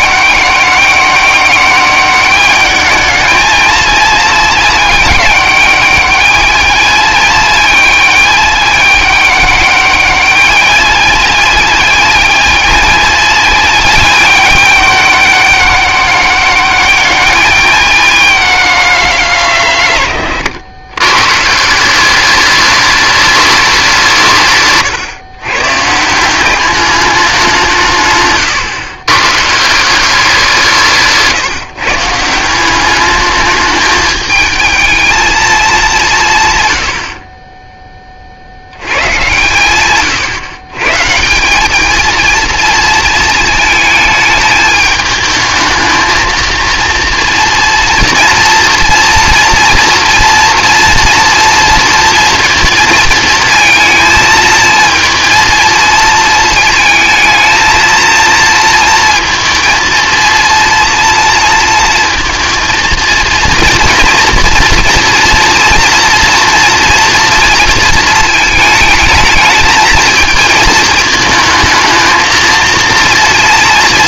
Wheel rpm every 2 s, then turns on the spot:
200, 210, 220, 220, 210, 210, 220, 210, 210, 190, 110, 210, 140, 200, 120, 180, 180, 220, 100, 90, 140, 230, 220, 230, 230, 230, 230, 220, 230, 230, 230, 230, 230, 240, 220, 230, 230.
none